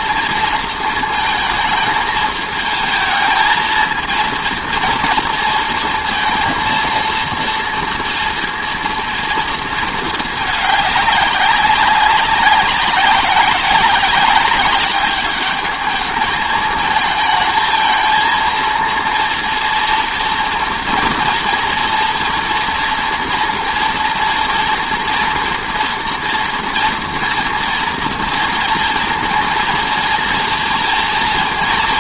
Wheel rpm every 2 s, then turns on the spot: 230, 220, 230, 230, 230, 210, 190, 200, 220, 230, 230, 230, 240, 230, 230, 220.
none